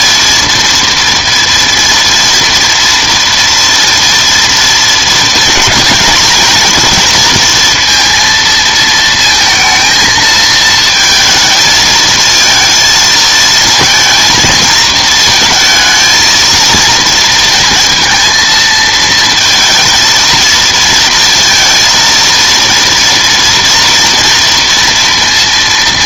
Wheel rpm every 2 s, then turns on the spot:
230, 230, 220, 230, 230, 220, 220, 220, 230, 230, 230, 230, 230.
none